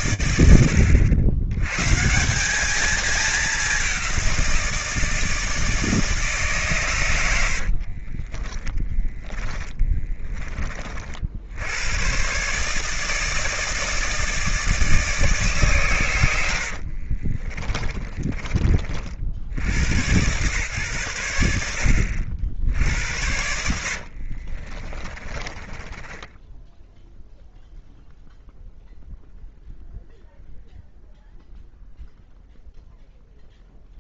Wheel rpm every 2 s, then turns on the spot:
100, 210, 160, 80, 20, 90, 160, 140, 40, 80, 90, 90, 20, 0, 0, 0, 0.
6-10 16-18 22-26